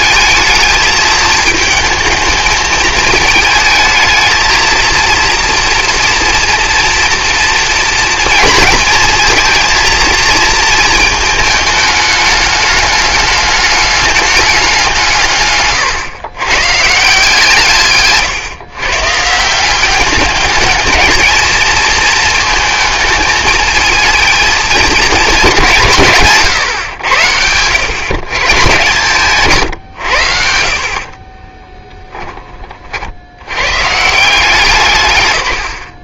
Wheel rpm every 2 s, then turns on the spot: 220, 220, 220, 230, 230, 230, 210, 190, 130, 130, 210, 220, 220, 130, 140, 60, 20, 170.
none